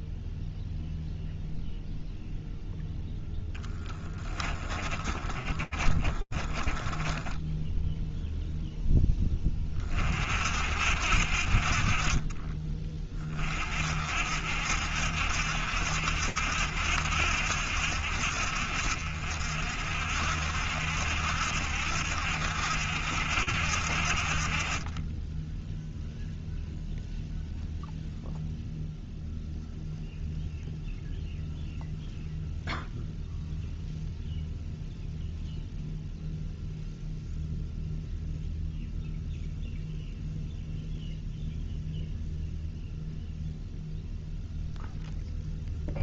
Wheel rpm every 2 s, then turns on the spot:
0, 0, 20, 20, 0, 60, 30, 70, 70, 60, 70, 70, 20, 0, 0, 0, 0, 0, 0, 0, 0, 0, 0.
4-8